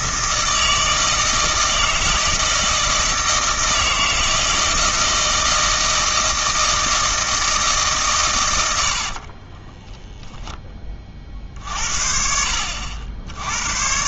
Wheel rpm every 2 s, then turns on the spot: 160, 160, 160, 160, 90, 20, 60.
8-10